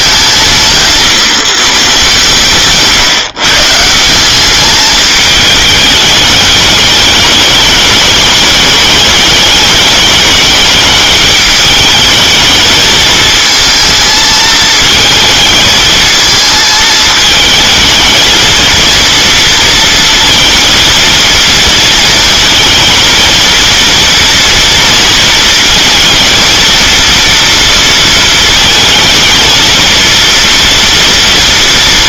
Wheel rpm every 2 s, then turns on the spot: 170, 140, 210, 220, 210, 210, 220, 220, 220, 230, 230, 230, 230, 230, 220, 230.
none